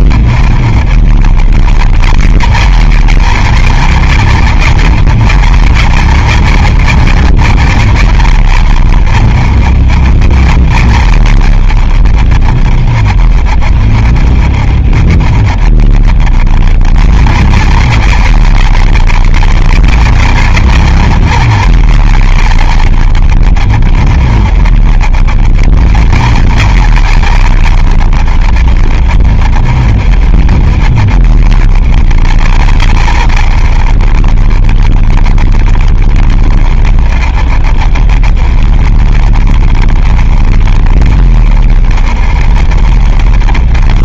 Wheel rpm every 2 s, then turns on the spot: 30, 50, 50, 50, 50, 40, 30, 30, 30, 50, 50, 40, 30, 50, 40, 30, 40, 30, 30, 30, 30, 30.
none